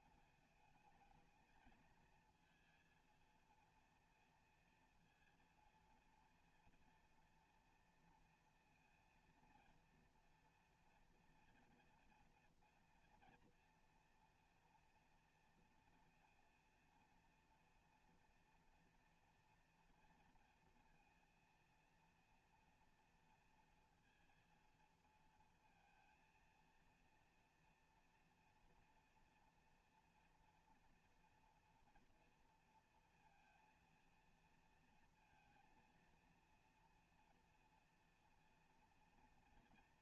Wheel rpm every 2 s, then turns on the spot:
220, 230, 230, 230, 230, 230, 240, 230, 230, 230, 230, 240, 230, 230, 230, 230, 230, 230, 230, 230.
none